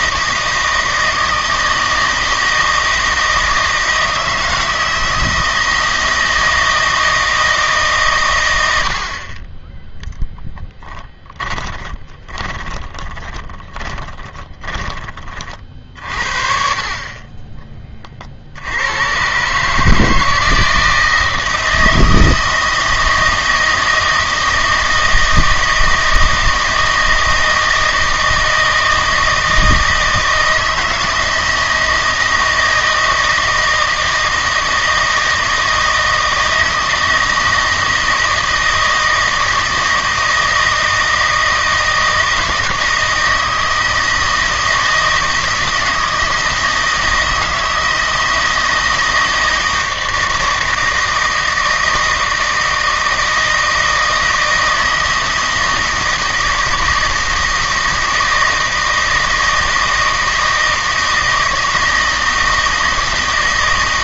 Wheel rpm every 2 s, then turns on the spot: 160, 160, 160, 160, 90, 20, 20, 20, 40, 80, 160, 160, 160, 160, 160, 160, 160, 160, 160, 160, 160, 160, 160, 160, 160, 160, 160, 160, 160, 160, 160, 160.
10-16